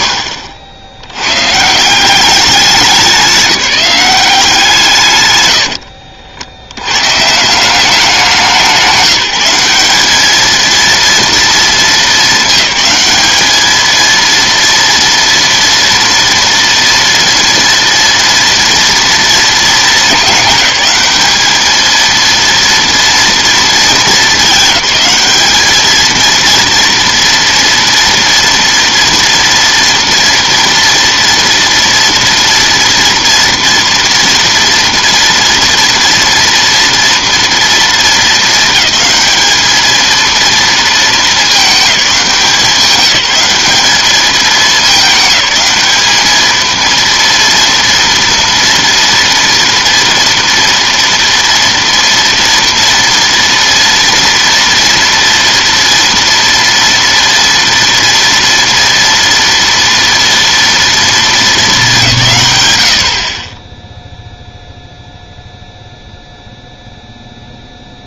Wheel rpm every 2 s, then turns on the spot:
80, 200, 170, 90, 180, 230, 220, 230, 230, 230, 210, 230, 200, 230, 230, 230, 230, 230, 230, 220, 220, 190, 210, 220, 230, 230, 230, 230, 230, 230, 230, 130, 0, 0.
none